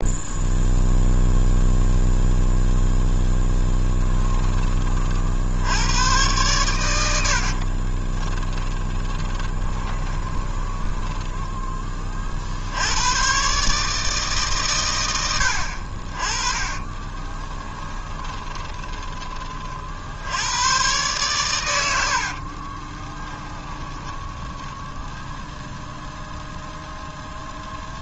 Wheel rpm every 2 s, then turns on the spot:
0, 0, 20, 100, 20, 20, 70, 130, 30, 20, 110, 40, 10, 0.
8-12 16-20 22-26